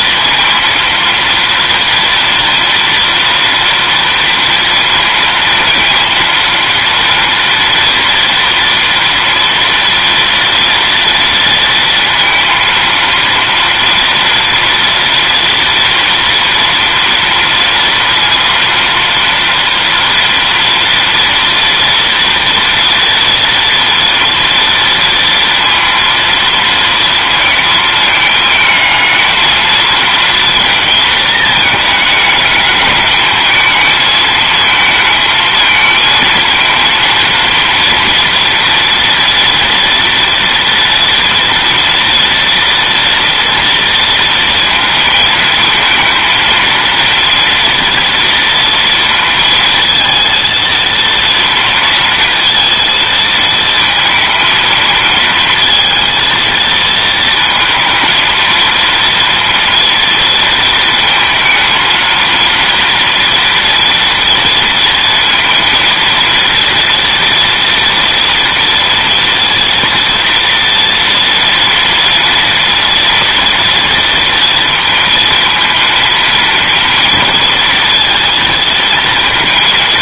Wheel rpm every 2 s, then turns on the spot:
230, 230, 230, 230, 230, 230, 230, 230, 230, 230, 230, 230, 230, 230, 220, 230, 210, 220, 230, 230, 230, 230, 230, 230, 230, 230, 230, 230, 230, 230, 230, 230, 230, 230, 230, 230, 230, 230, 230, 220.
none